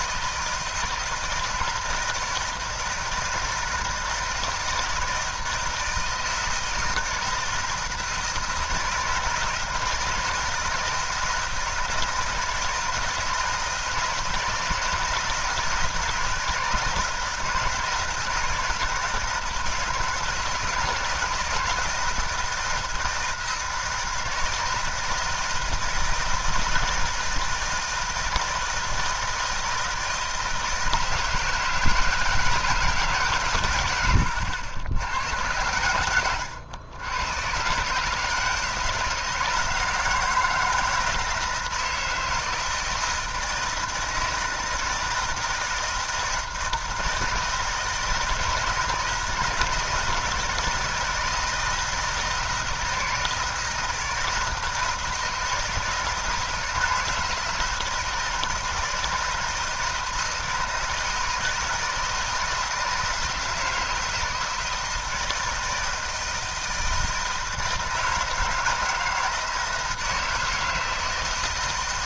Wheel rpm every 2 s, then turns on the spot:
160, 160, 160, 160, 160, 160, 160, 160, 160, 160, 160, 160, 160, 160, 160, 160, 160, 90, 100, 160, 160, 160, 160, 160, 160, 160, 160, 160, 160, 160, 160, 160, 160, 160, 160, 160.
none